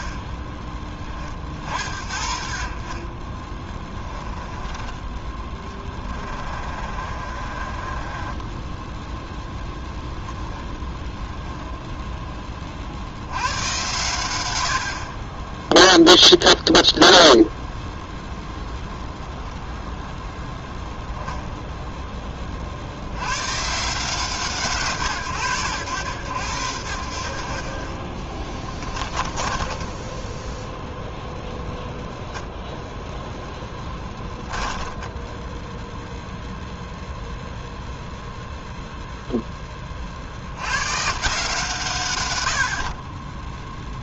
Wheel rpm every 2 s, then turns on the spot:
30, 40, 20, 30, 10, 10, 40, 70, 0, 0, 10, 50, 150, 90, 20, 10, 10, 10, 0, 0, 100, 60.
4-10 28-30 34-36